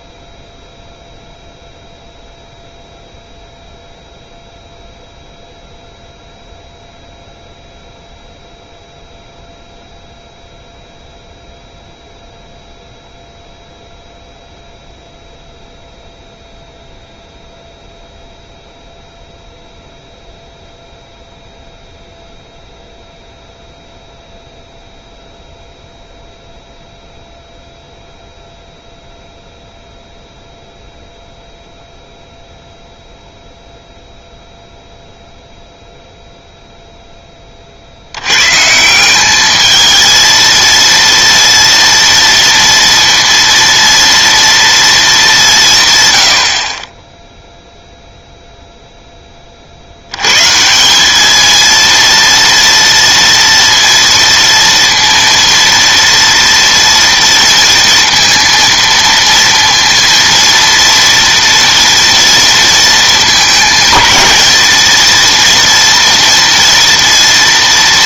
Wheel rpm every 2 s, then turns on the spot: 0, 0, 0, 0, 0, 0, 0, 0, 0, 0, 0, 0, 0, 0, 0, 0, 0, 0, 0, 130, 230, 230, 230, 60, 0, 160, 230, 230, 230, 230, 230, 230, 220, 230.
none